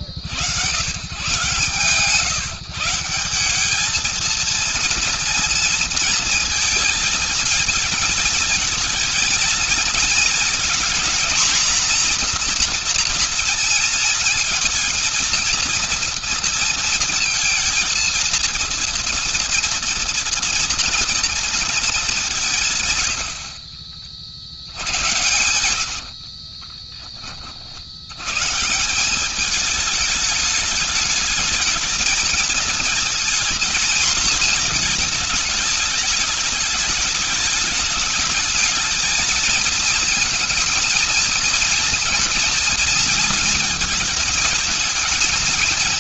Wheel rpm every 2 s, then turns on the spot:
50, 150, 220, 230, 220, 230, 230, 230, 230, 230, 230, 190, 60, 50, 90, 210, 220, 230, 210, 210, 230, 230, 220.
26-28